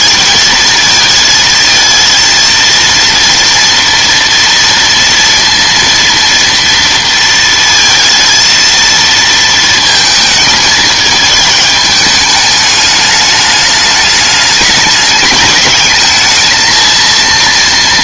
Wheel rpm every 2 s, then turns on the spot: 220, 230, 230, 230, 230, 220, 210, 210, 220.
none